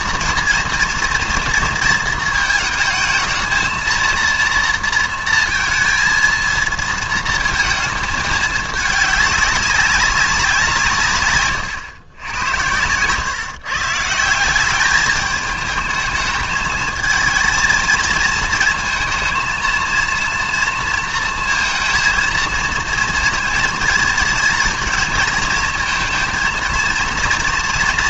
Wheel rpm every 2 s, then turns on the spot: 230, 220, 230, 230, 210, 170, 90, 190, 220, 230, 230, 230, 230, 230.
none